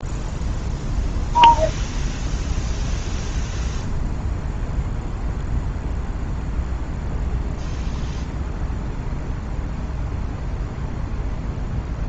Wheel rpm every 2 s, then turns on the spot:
0, 0, 0, 0, 0, 0.
none